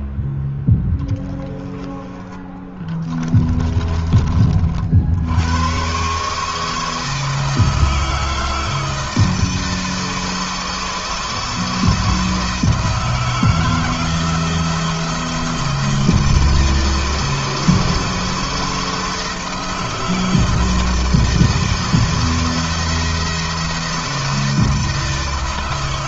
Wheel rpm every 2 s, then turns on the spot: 10, 10, 80, 160, 160, 160, 160, 160, 160, 160, 160, 160, 160.
2-4